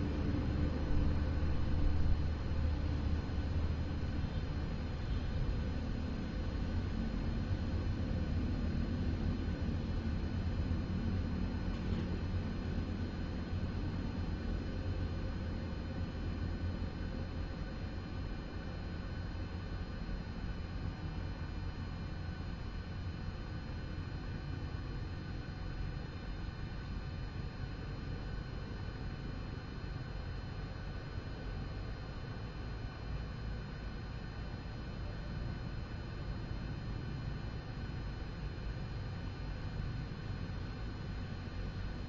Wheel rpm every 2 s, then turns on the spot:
0, 0, 0, 0, 0, 0, 0, 0, 0, 0, 0, 0, 0, 0, 0, 0, 0, 0, 0, 0, 0.
none